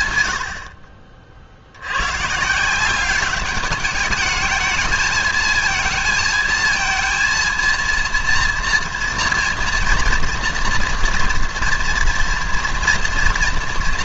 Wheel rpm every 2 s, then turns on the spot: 60, 160, 220, 220, 230, 230, 230.
none